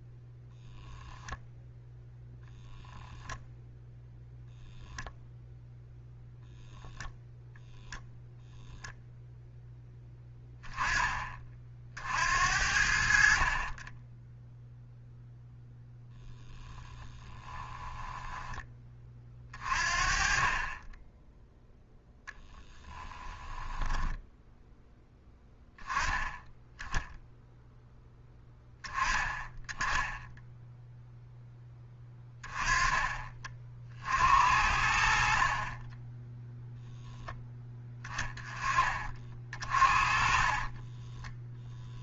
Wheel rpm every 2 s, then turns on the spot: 0, 0, 0, 0, 0, 10, 60, 0, 10, 20, 20, 10, 10, 0, 10, 0, 20, 60, 0, 20, 20.
16-18 22-24 40-42